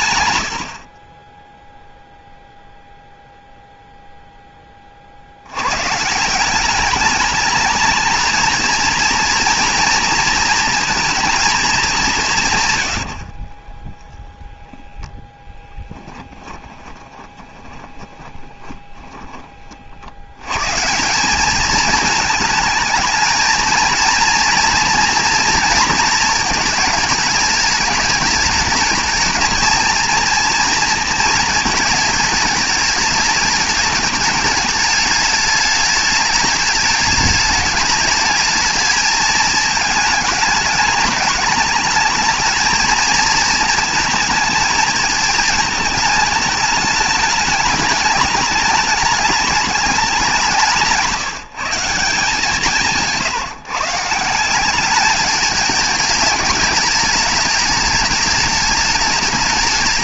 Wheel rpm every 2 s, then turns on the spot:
70, 0, 20, 200, 230, 230, 140, 10, 20, 20, 150, 220, 230, 220, 220, 230, 210, 210, 210, 210, 220, 220, 220, 210, 210, 170, 170, 200, 210, 210.
14-20